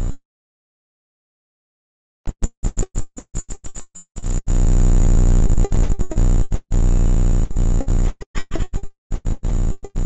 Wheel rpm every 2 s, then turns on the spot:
0, 0, 0, 0, 10.
none